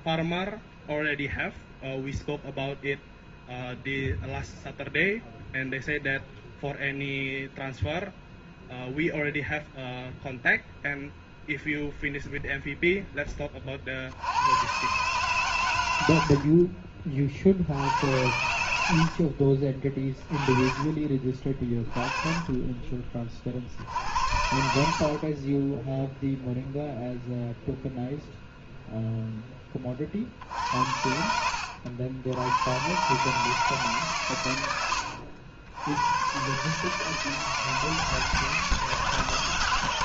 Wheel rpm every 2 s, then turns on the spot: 0, 0, 0, 0, 0, 0, 0, 120, 40, 80, 30, 30, 60, 0, 0, 70, 100, 110, 140, 160.
24-26